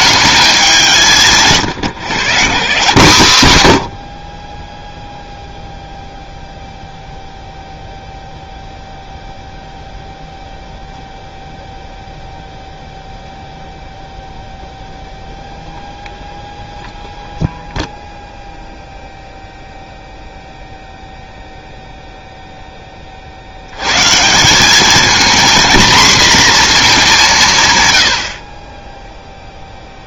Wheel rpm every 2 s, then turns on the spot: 190, 160, 20, 0, 0, 0, 0, 0, 0, 0, 0, 0, 190, 230, 40.
none